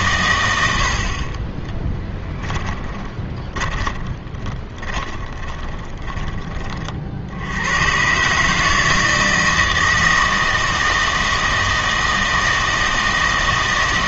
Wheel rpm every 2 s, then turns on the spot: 80, 20, 20, 30, 150, 160, 160.
2-6